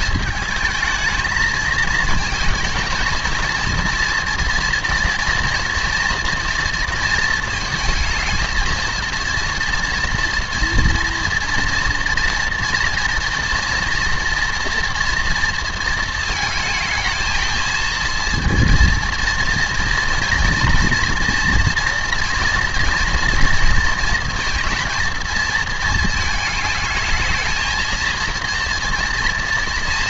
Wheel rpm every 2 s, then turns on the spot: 220, 220, 230, 230, 220, 230, 230, 230, 220, 230, 230, 230, 220, 220, 230.
none